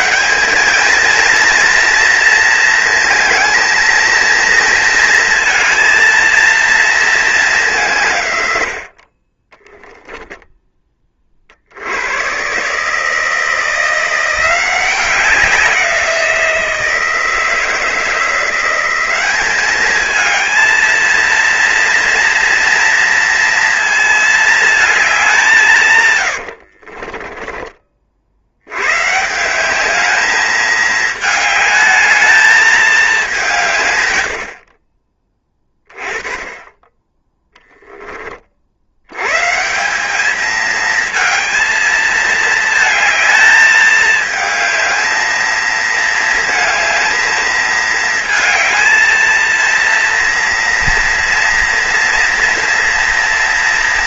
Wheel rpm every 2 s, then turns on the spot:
210, 230, 230, 230, 60, 10, 150, 180, 160, 180, 230, 230, 210, 50, 120, 220, 210, 40, 10, 60, 220, 220, 220, 220, 220, 230, 230.
26-28